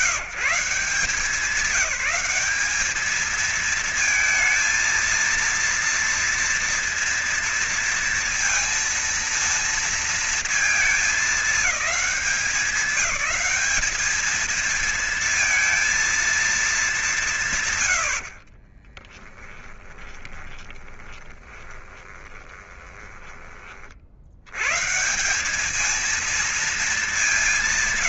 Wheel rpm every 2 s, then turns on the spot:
170, 200, 230, 230, 230, 220, 190, 220, 210, 40, 20, 20, 120, 220.
18-24